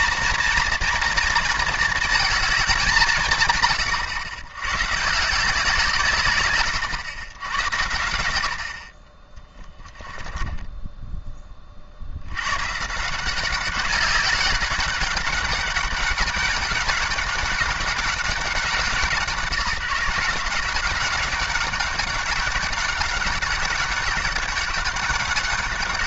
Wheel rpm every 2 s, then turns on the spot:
230, 170, 130, 110, 50, 10, 130, 190, 200, 180, 190, 190, 190.
8-12